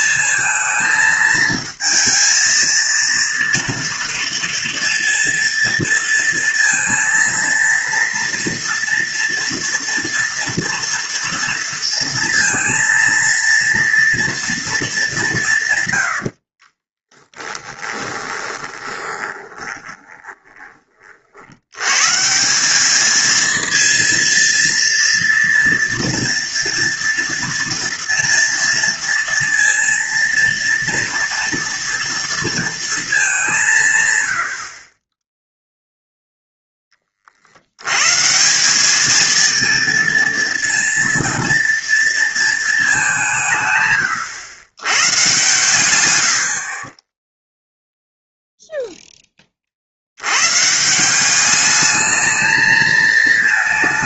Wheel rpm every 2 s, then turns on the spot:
220, 230, 230, 230, 230, 230, 230, 220, 20, 20, 30, 200, 230, 230, 230, 230, 230, 40, 20, 200, 230, 210, 110, 40, 0, 150, 220.
16-20